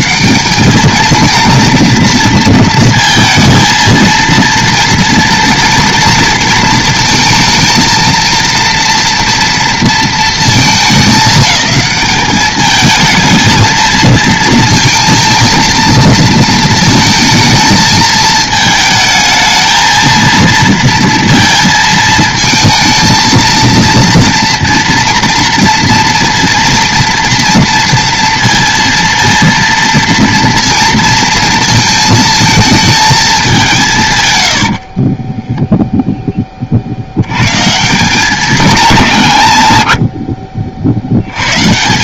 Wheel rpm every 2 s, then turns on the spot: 200, 230, 230, 230, 230, 210, 220, 230, 220, 220, 230, 230, 230, 230, 230, 230, 220, 50, 60, 180, 60.
34-36